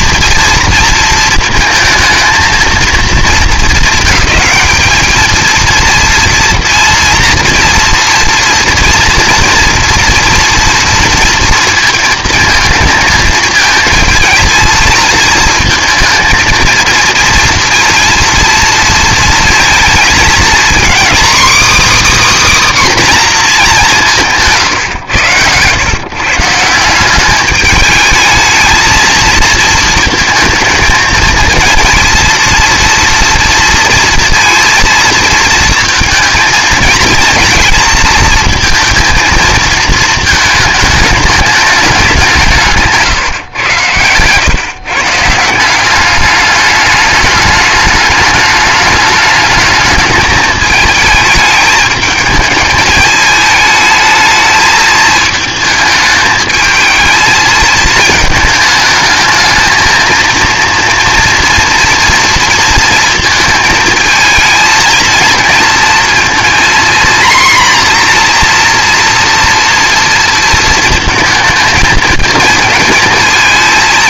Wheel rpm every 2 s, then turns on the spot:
230, 230, 220, 230, 230, 230, 220, 220, 230, 230, 250, 290, 140, 160, 220, 220, 230, 230, 230, 230, 210, 160, 130, 210, 210, 220, 210, 220, 220, 220, 230, 230, 220, 240, 240, 230, 230.
none